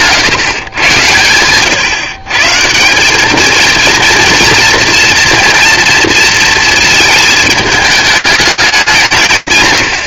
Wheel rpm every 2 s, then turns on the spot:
120, 160, 230, 220, 210.
none